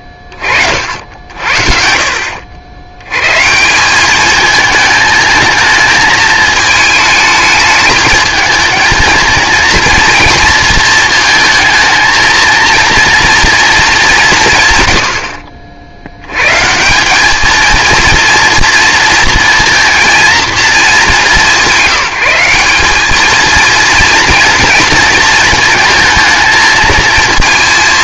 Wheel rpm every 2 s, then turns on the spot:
30, 80, 220, 220, 220, 220, 230, 130, 160, 230, 200, 190, 230, 220.
none